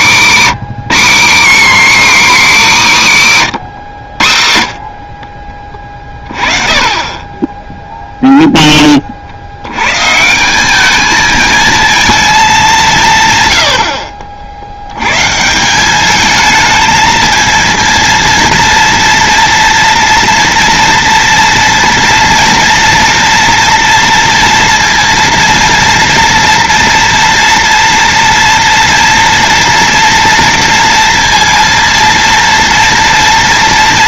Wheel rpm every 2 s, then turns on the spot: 190, 290, 80, 30, 0, 160, 220, 50, 210, 230, 230, 230, 230, 230, 230, 230, 230.
none